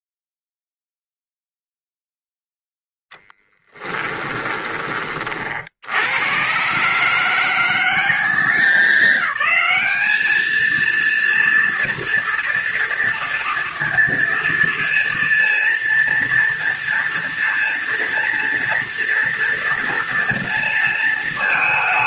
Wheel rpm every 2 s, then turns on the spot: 0, 0, 20, 140, 190, 220, 230, 230, 230, 230, 230.
none